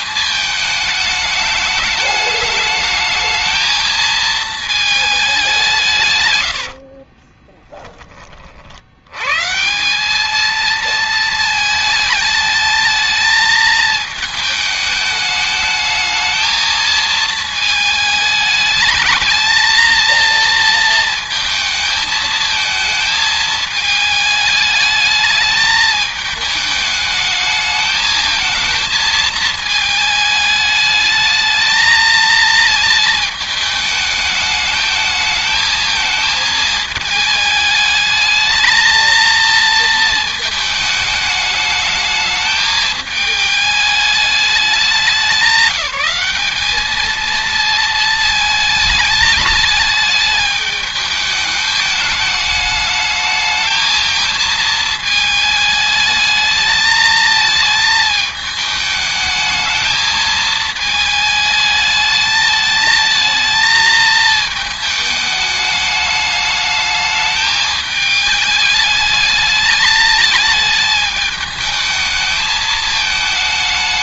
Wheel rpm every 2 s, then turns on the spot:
210, 220, 130, 30, 190, 220, 220, 220, 220, 220, 220, 210, 210, 220, 220, 220, 210, 220, 210, 230, 220, 210, 200, 220, 210, 210, 220, 220, 220, 220, 210, 220, 210, 210, 220, 220, 220.
4-6